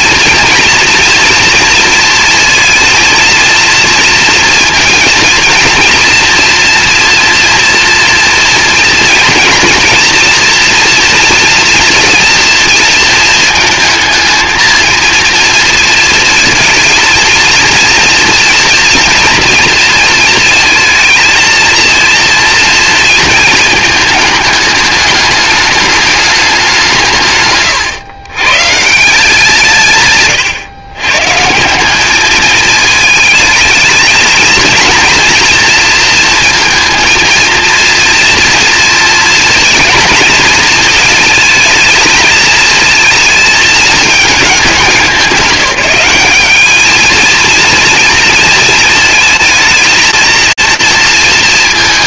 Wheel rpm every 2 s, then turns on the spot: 230, 230, 230, 240, 230, 240, 230, 220, 220, 230, 220, 230, 210, 180, 140, 120, 220, 230, 230, 240, 230, 220, 200, 220, 230, 230.
none